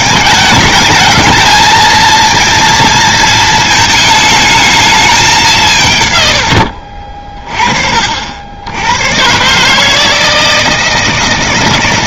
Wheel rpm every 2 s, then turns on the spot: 220, 230, 220, 80, 80, 160.
6-8